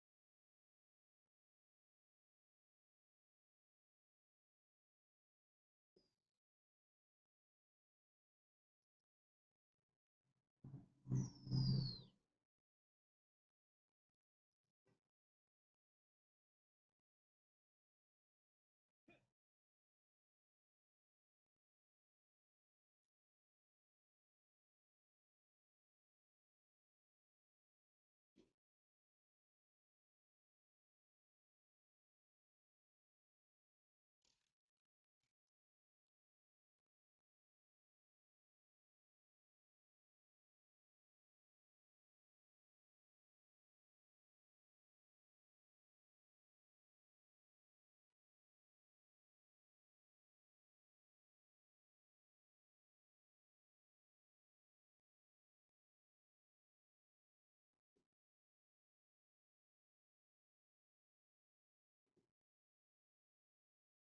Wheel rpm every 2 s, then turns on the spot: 0, 0, 0, 0, 0, 0, 0, 0, 0, 0, 0, 0, 0, 0, 0, 0, 0, 0, 0, 0, 0, 0, 0, 0, 0, 0, 0, 0, 0, 0, 0, 0.
none